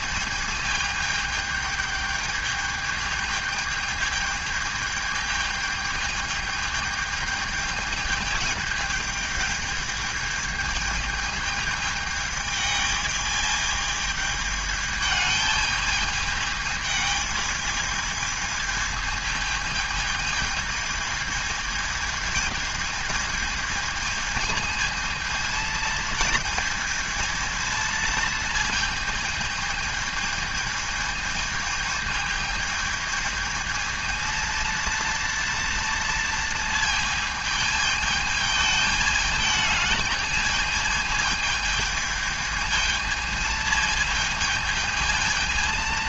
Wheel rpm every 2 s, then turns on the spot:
220, 210, 220, 220, 220, 220, 220, 210, 220, 220, 220, 220, 220, 230, 220, 220, 220, 230, 230, 220, 220, 220, 220.
none